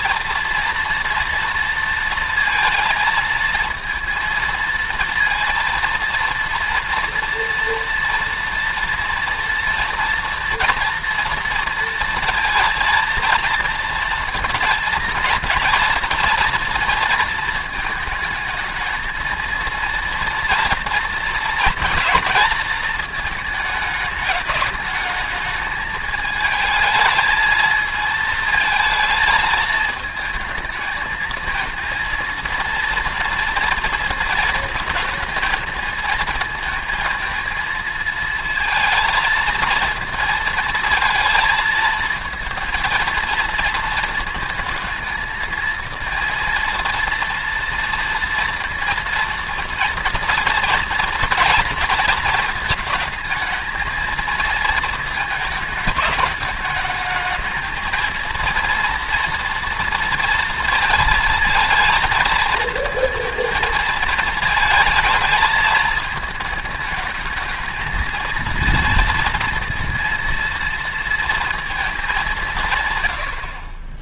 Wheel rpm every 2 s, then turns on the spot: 230, 220, 230, 230, 230, 240, 220, 230, 230, 220, 230, 230, 210, 220, 220, 220, 230, 220, 220, 230, 230, 230, 230, 230, 230, 230, 220, 220, 210, 230, 230, 220, 220, 220, 230, 230, 160.
none